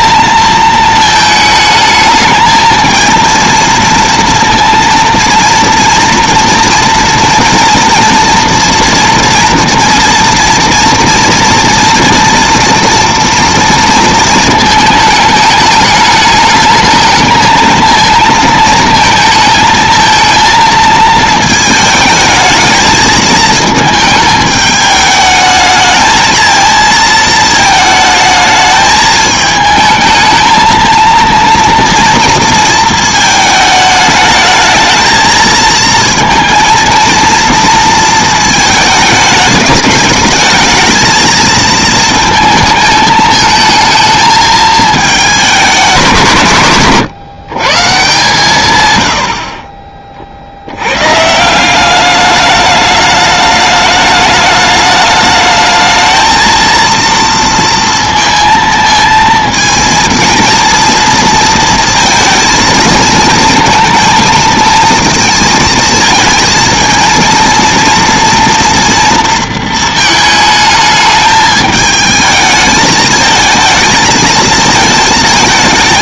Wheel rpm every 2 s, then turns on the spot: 230, 220, 230, 230, 230, 230, 230, 220, 210, 230, 220, 220, 210, 230, 220, 220, 230, 210, 230, 220, 220, 220, 220, 140, 150, 70, 210, 210, 230, 230, 230, 230, 220, 230, 240, 220, 220, 220.
none